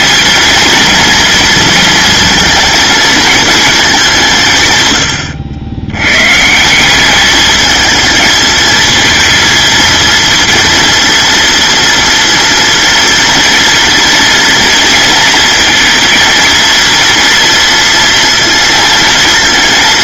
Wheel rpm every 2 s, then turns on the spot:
230, 230, 110, 190, 220, 230, 230, 230, 230, 230.
4-6